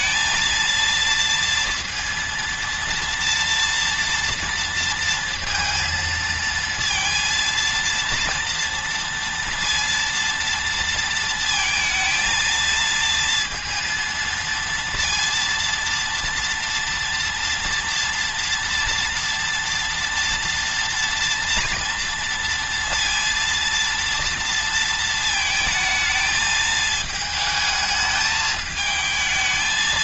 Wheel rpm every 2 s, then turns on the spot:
230, 230, 230, 230, 230, 230, 230, 230, 230, 230, 230, 230, 230, 220, 220.
none